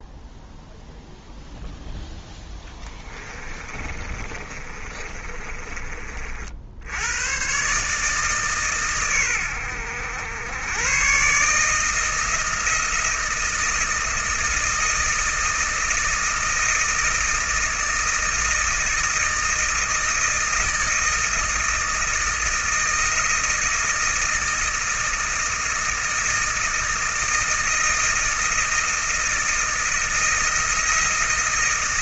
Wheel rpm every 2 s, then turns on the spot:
0, 10, 30, 90, 120, 120, 160, 160, 160, 160, 160, 160, 160, 160, 160, 160.
2-6